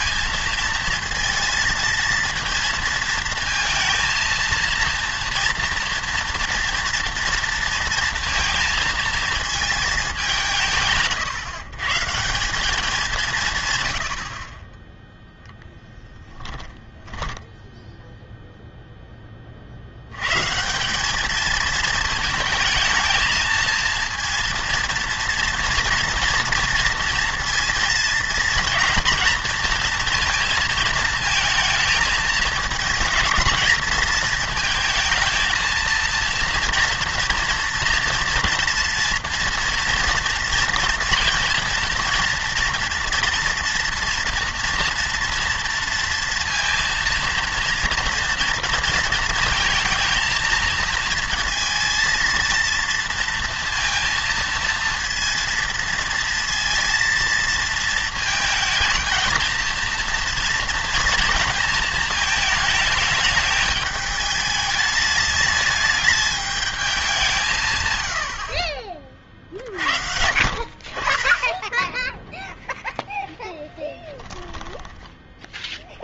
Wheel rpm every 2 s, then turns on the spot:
230, 230, 230, 230, 230, 150, 190, 30, 10, 0, 160, 220, 230, 230, 230, 230, 220, 220, 230, 230, 230, 240, 230, 230, 230, 220, 230, 230, 230, 220, 230, 220, 210, 210, 50, 50, 0, 10.
16-18 74-76